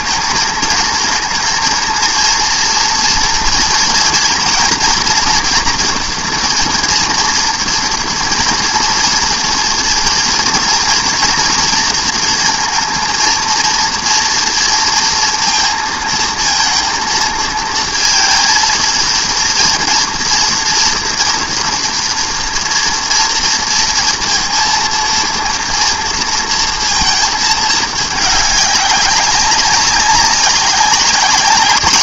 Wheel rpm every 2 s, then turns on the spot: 220, 230, 240, 230, 230, 230, 230, 230, 230, 230, 230, 230, 230, 230, 200, 200.
none